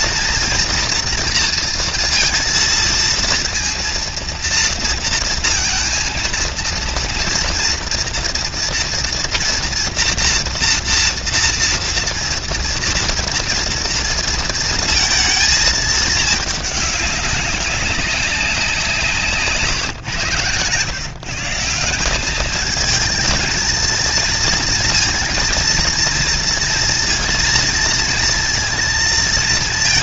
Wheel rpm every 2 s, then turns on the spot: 230, 230, 230, 230, 230, 230, 230, 230, 200, 160, 140, 230, 230, 230, 230.
none